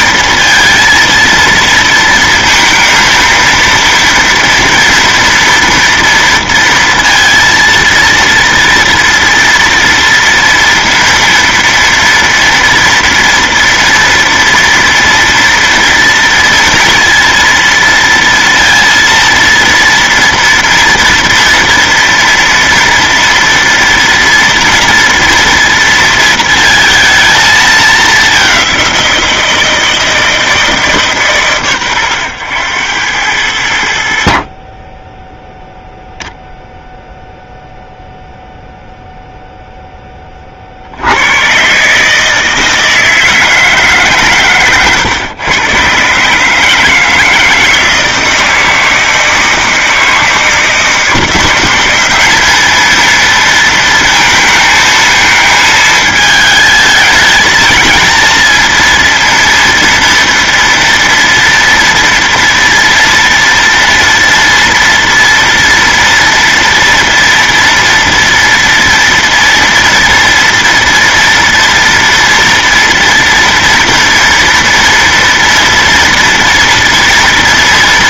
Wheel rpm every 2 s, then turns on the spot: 230, 230, 230, 230, 230, 230, 230, 230, 230, 230, 230, 230, 230, 230, 200, 160, 100, 40, 0, 0, 40, 160, 130, 150, 160, 160, 210, 230, 220, 230, 230, 240, 230, 230, 230, 230, 240, 230, 230.
44-46